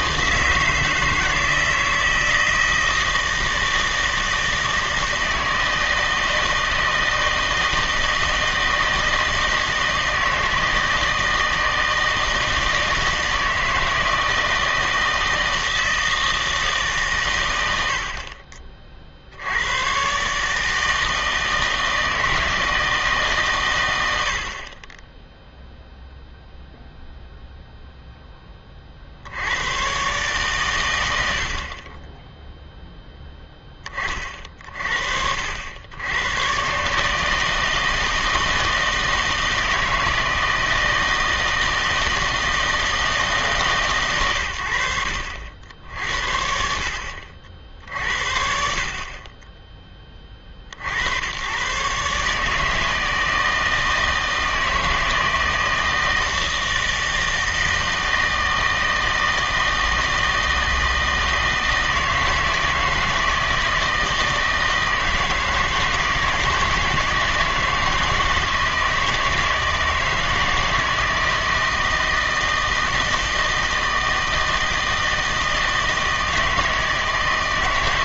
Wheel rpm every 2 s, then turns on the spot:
160, 160, 160, 160, 160, 160, 160, 160, 160, 40, 150, 160, 30, 0, 20, 110, 0, 50, 120, 160, 160, 160, 80, 60, 60, 40, 150, 160, 160, 160, 160, 160, 160, 160, 160, 160, 160, 160, 160.
24-26